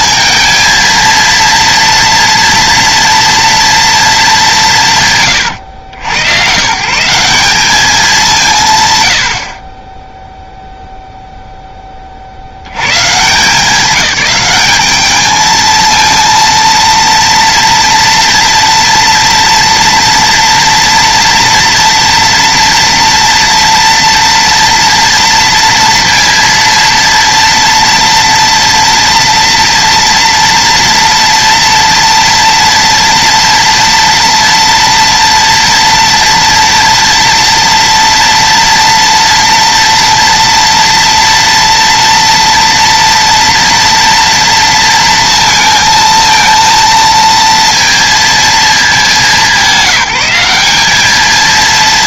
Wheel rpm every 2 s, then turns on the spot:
230, 240, 130, 180, 110, 0, 100, 210, 230, 230, 230, 240, 230, 230, 230, 230, 230, 230, 230, 230, 230, 230, 230, 230, 200, 210.
none